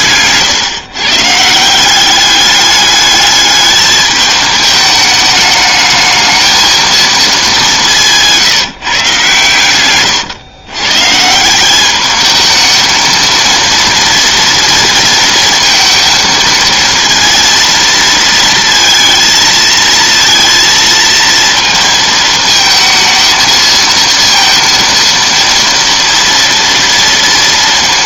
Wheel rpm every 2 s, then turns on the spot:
140, 210, 210, 220, 170, 120, 220, 230, 230, 230, 230, 220, 230, 230.
none